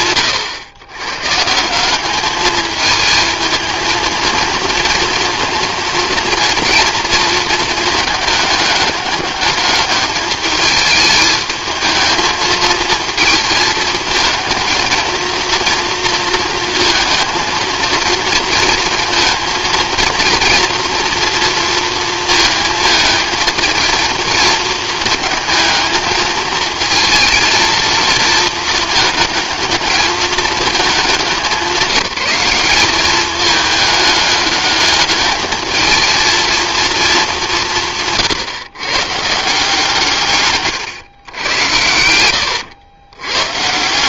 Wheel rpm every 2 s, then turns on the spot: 110, 220, 230, 230, 200, 210, 220, 230, 230, 230, 230, 220, 220, 230, 220, 200, 200, 210, 220, 130, 120, 110.
none